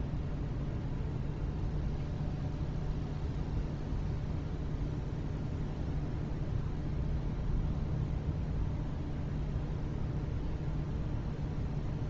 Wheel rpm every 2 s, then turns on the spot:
0, 0, 0, 0, 0, 0.
none